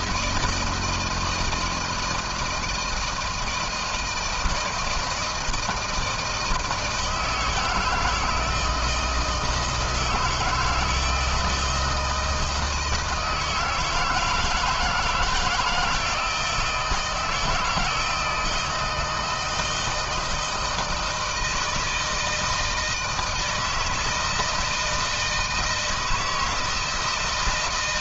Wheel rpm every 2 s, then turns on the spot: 160, 160, 160, 160, 160, 160, 160, 160, 160, 160, 160, 160, 160, 160.
none